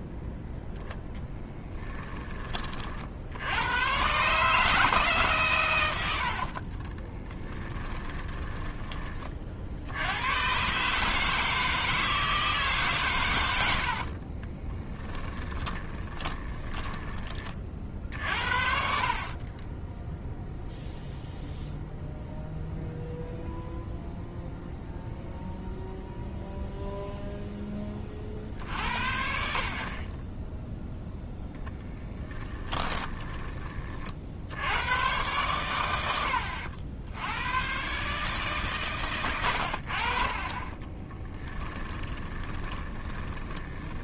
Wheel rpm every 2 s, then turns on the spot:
10, 40, 150, 30, 20, 140, 140, 10, 10, 50, 0, 0, 0, 0, 50, 0, 10, 90, 80, 120, 20, 10.
6-8 14-20 32-34 40-44